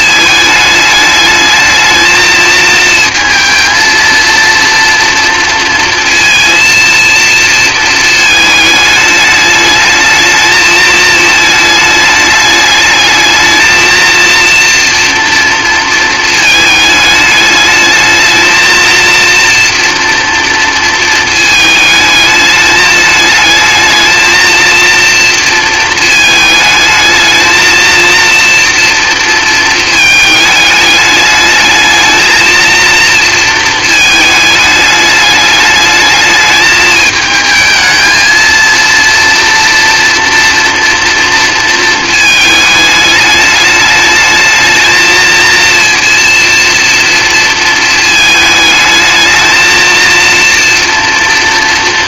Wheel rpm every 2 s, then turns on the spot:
210, 220, 230, 230, 220, 220, 210, 230, 220, 220, 230, 210, 230, 220, 230, 220, 220, 220, 210, 230, 230, 220, 220, 230, 220, 230.
none